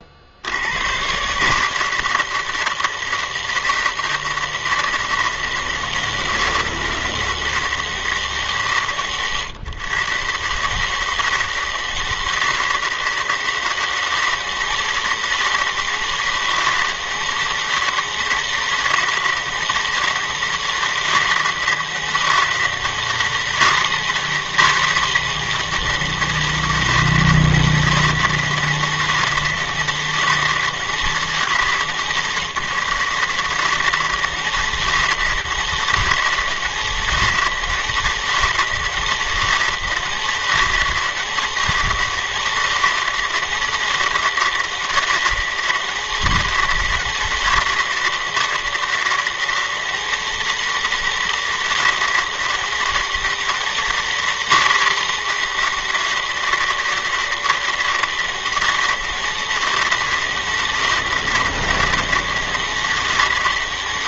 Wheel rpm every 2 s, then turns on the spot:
110, 160, 160, 160, 120, 150, 170, 200, 200, 200, 200, 210, 230, 200, 200, 190, 170, 200, 200, 200, 200, 200, 200, 200, 200, 200, 200, 230, 200, 200, 200, 200.
none